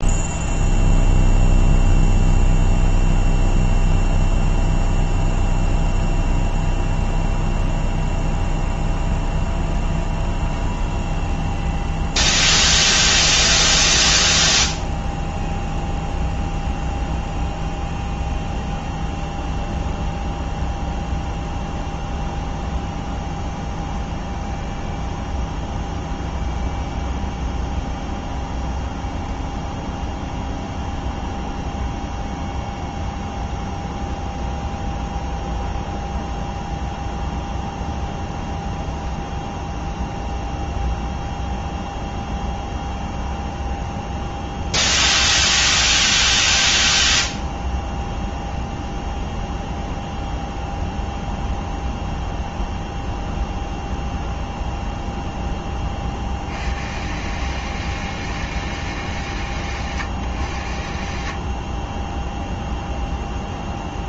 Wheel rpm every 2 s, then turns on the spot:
0, 0, 0, 0, 0, 0, 0, 0, 0, 0, 0, 0, 0, 0, 0, 0, 0, 0, 0, 0, 0, 0, 0, 0, 0, 0, 0, 0, 100, 150, 90, 0.
none